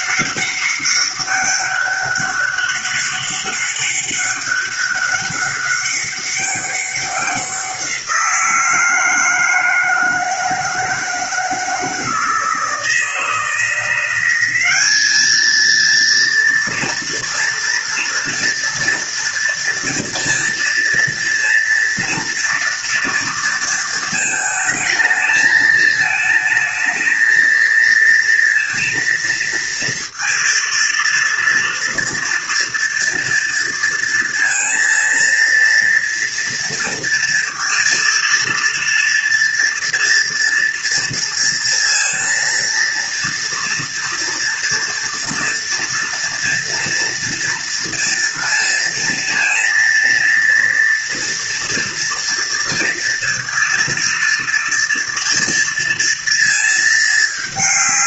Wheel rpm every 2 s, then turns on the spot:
200, 200, 200, 190, 160, 160, 160, 210, 230, 230, 230, 230, 220, 220, 230, 230, 230, 230, 230, 230, 230, 230, 230, 230, 230, 230, 230, 230, 220.
none